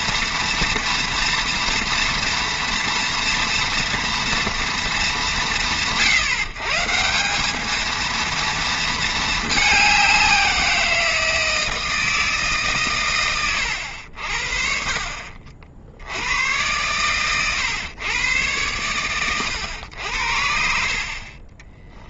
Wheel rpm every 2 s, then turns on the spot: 230, 230, 230, 140, 230, 170, 140, 40, 110, 110, 60.
none